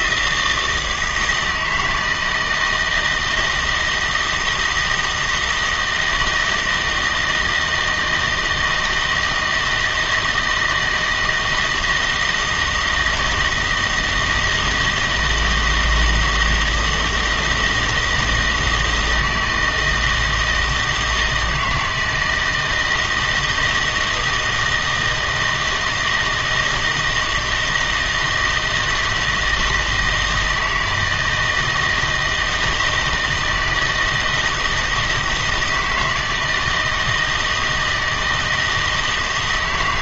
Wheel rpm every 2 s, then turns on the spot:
160, 160, 160, 160, 160, 160, 160, 160, 160, 160, 160, 160, 160, 160, 160, 160, 160, 170, 160, 160.
none